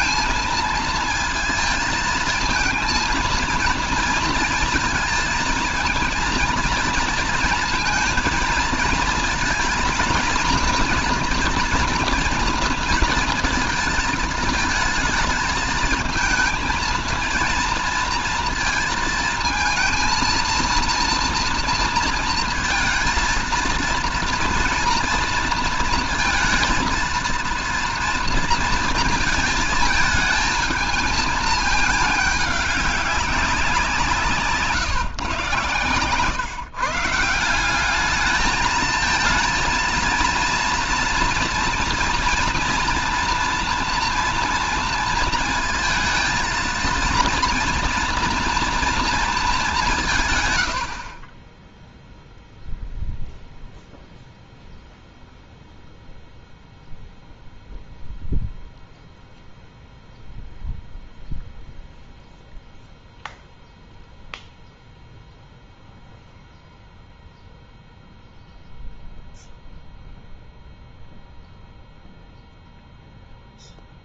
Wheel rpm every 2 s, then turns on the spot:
230, 230, 230, 230, 230, 240, 230, 220, 230, 230, 230, 230, 230, 230, 230, 220, 200, 140, 140, 220, 230, 230, 230, 230, 230, 90, 0, 0, 0, 0, 0, 0, 0, 0, 0, 0, 0.
none